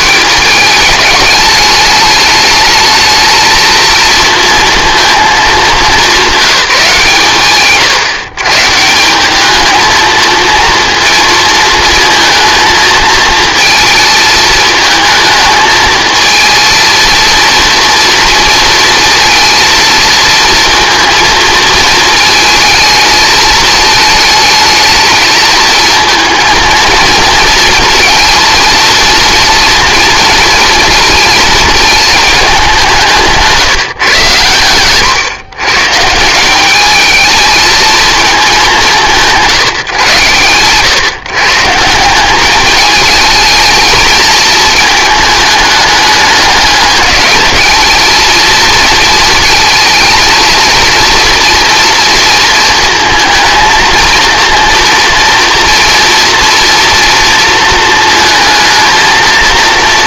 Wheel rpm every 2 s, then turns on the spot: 200, 220, 230, 180, 170, 230, 220, 220, 220, 230, 230, 220, 220, 230, 230, 230, 190, 120, 200, 180, 130, 210, 220, 210, 230, 230, 230, 230, 230, 230.
none